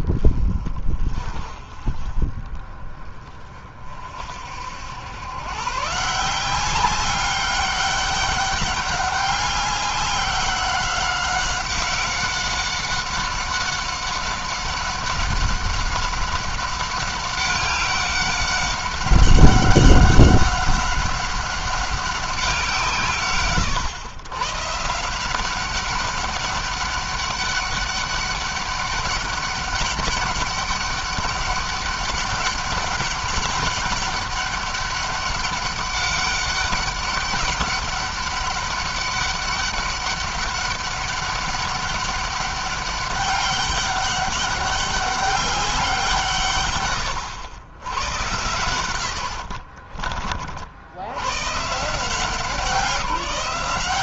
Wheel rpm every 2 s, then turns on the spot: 30, 30, 80, 190, 200, 190, 190, 190, 190, 190, 190, 170, 140, 200, 200, 200, 200, 200, 200, 200, 200, 200, 190, 120, 90, 60, 180.
46-50